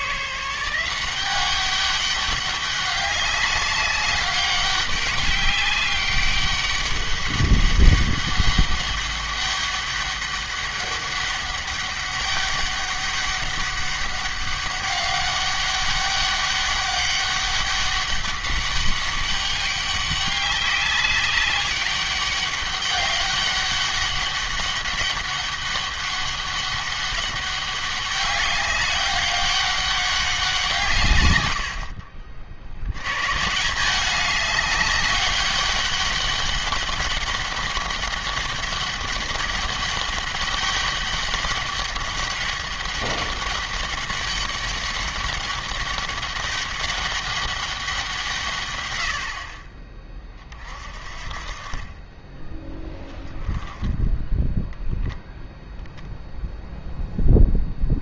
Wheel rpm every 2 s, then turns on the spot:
170, 200, 200, 200, 200, 200, 200, 200, 200, 200, 200, 200, 200, 200, 190, 160, 90, 200, 200, 200, 200, 200, 200, 200, 120, 50, 10, 0, 0.
none